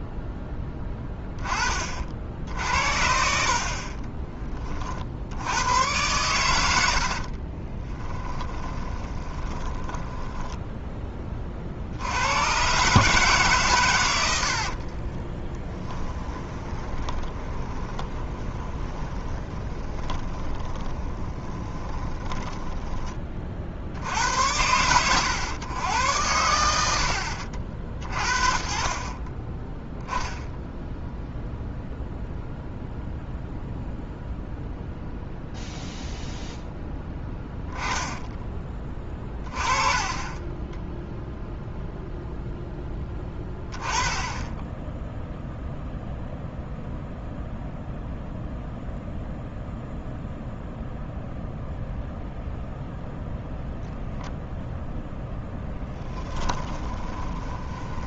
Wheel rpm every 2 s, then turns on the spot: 10, 70, 40, 80, 20, 10, 130, 50, 20, 10, 20, 20, 90, 90, 40, 0, 0, 0, 0, 20, 10, 10, 10, 0, 0, 0, 0, 0, 10.
8-12 14-24 38-40 56-58